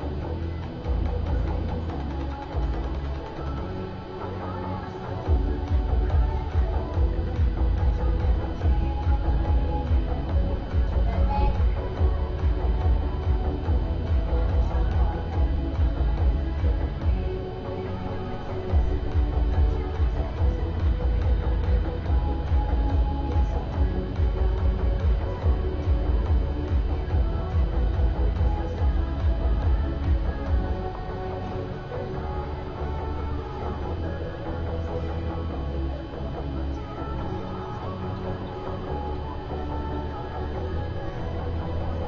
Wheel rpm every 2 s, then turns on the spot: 0, 0, 0, 0, 0, 0, 0, 0, 0, 0, 0, 0, 0, 0, 0, 0, 0, 0, 0, 0, 0.
none